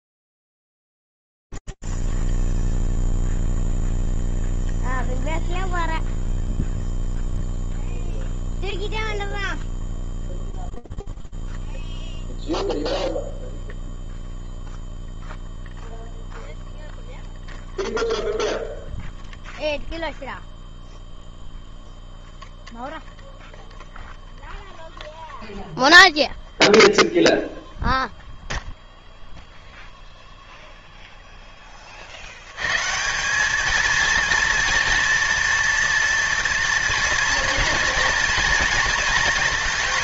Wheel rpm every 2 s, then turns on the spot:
0, 0, 0, 0, 0, 0, 0, 0, 0, 0, 0, 0, 0, 0, 0, 0, 170, 230, 240, 230.
none